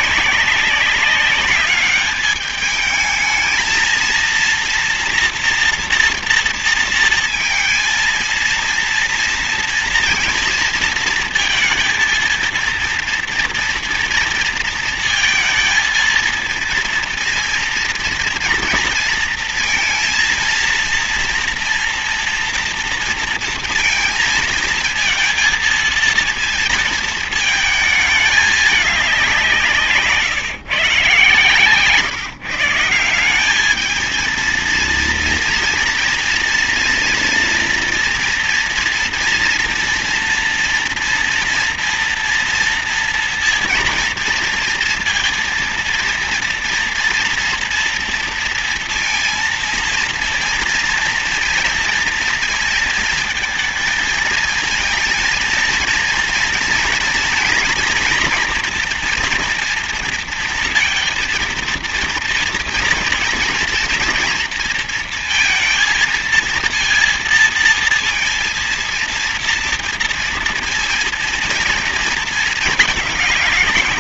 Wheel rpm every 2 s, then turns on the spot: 200, 210, 230, 230, 230, 230, 230, 230, 230, 230, 230, 230, 230, 230, 210, 150, 160, 220, 230, 240, 230, 230, 230, 230, 230, 230, 230, 220, 230, 240, 230, 230, 230, 230, 230, 230, 230.
none